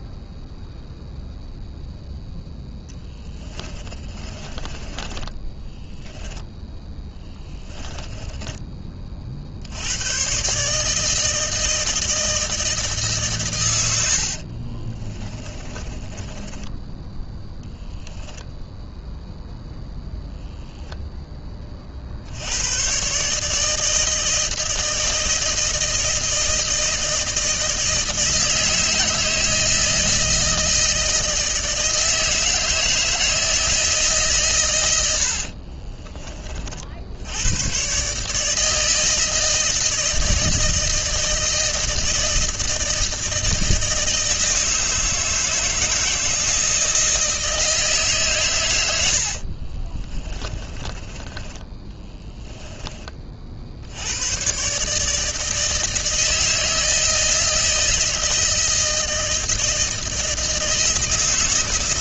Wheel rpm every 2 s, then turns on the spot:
0, 10, 30, 10, 20, 140, 160, 50, 10, 0, 0, 90, 160, 160, 160, 160, 160, 130, 40, 150, 160, 160, 160, 160, 120, 20, 20, 130, 160, 160, 160.
4-6 8-10 14-18 50-54